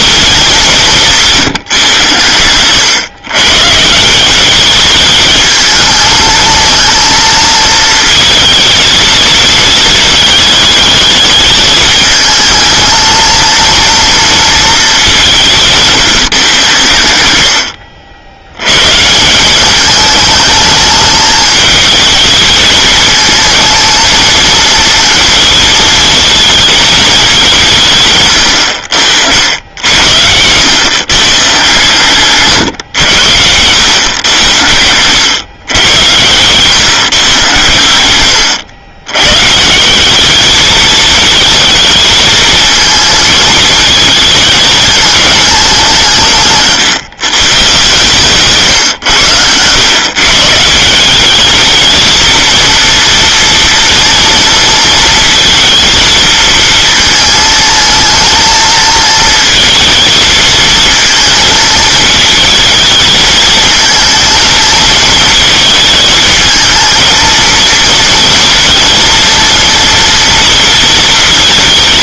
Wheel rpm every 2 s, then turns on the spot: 200, 110, 200, 230, 230, 220, 220, 220, 120, 120, 210, 220, 230, 220, 70, 110, 130, 100, 130, 100, 210, 220, 220, 150, 140, 160, 230, 230, 230, 230, 220, 220, 230, 220, 230, 230.
none